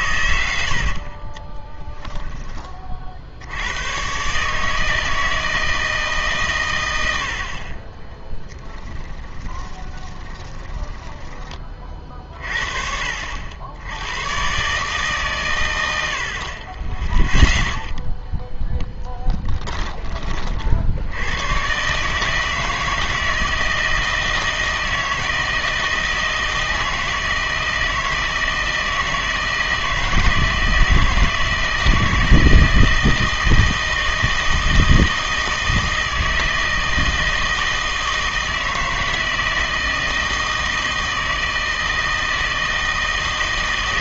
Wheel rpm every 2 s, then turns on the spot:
70, 30, 150, 110, 10, 20, 40, 130, 30, 0, 50, 160, 160, 160, 160, 160, 160, 160, 160, 160, 160, 160.
10-12